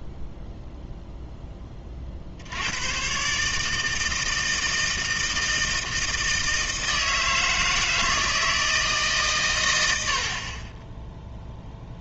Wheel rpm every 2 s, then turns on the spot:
0, 90, 160, 160, 160, 30.
none